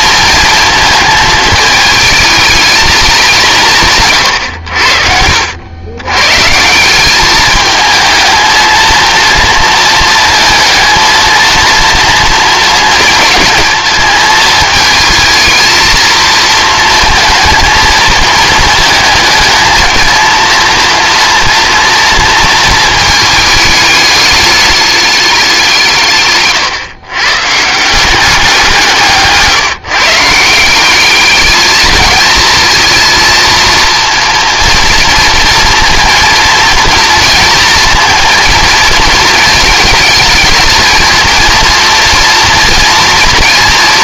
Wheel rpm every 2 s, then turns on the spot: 220, 220, 80, 180, 220, 220, 220, 220, 220, 220, 230, 220, 210, 130, 170, 190, 230, 230, 230, 230, 220, 230.
4-6